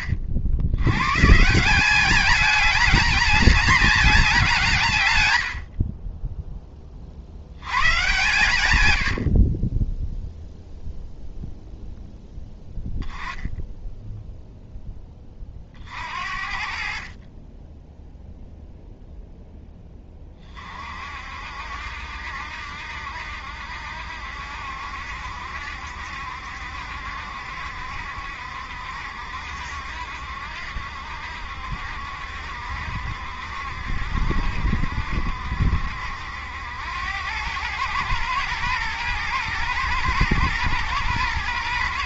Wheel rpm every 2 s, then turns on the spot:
110, 220, 160, 20, 110, 0, 10, 10, 50, 0, 40, 70, 70, 70, 70, 70, 70, 70, 90, 110, 110.
none